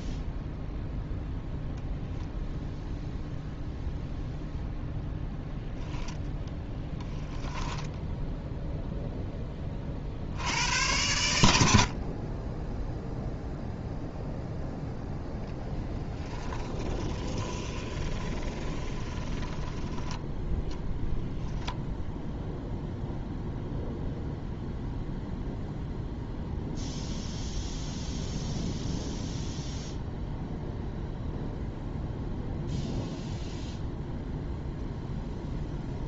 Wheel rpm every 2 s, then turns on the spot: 0, 0, 0, 0, 0, 80, 20, 0, 10, 20, 0, 0, 0, 0, 0, 0, 0, 0.
16-20